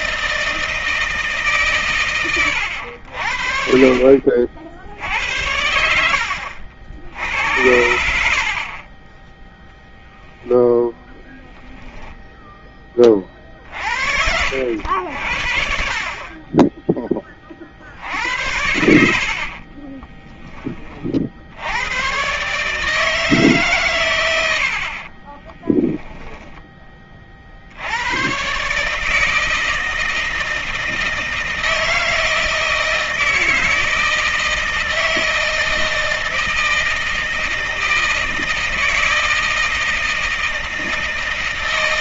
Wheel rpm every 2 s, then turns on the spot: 160, 70, 60, 70, 20, 0, 30, 70, 20, 80, 40, 150, 50, 40, 150, 160, 160, 160, 160, 160, 160.
24-26